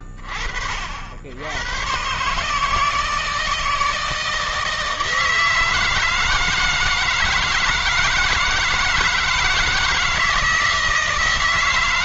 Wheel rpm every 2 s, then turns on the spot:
50, 160, 160, 160, 160, 160.
none